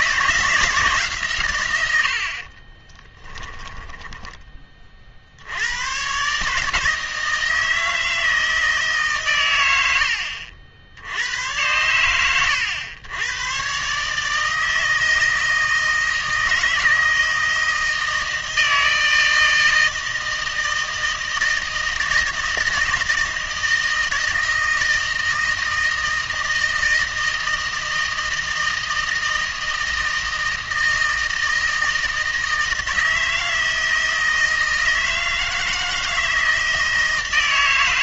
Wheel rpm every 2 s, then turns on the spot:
160, 30, 30, 160, 160, 70, 110, 160, 160, 160, 160, 160, 160, 160, 160, 160, 160, 160, 160.
2-4